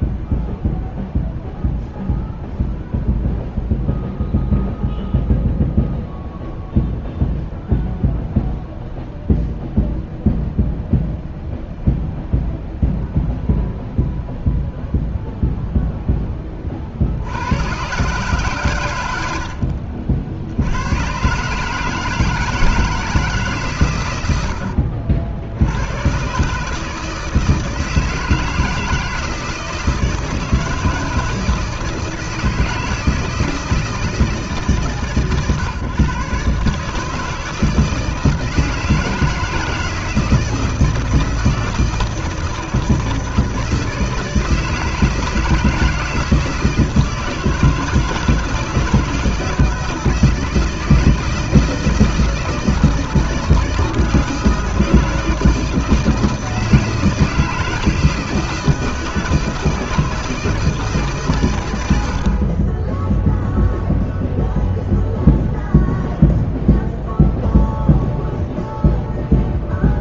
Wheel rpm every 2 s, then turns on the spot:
0, 0, 0, 0, 0, 0, 0, 0, 50, 90, 110, 160, 70, 150, 160, 160, 160, 140, 150, 160, 170, 160, 160, 160, 160, 160, 160, 160, 160, 160, 150, 10, 0, 0, 0.
24-26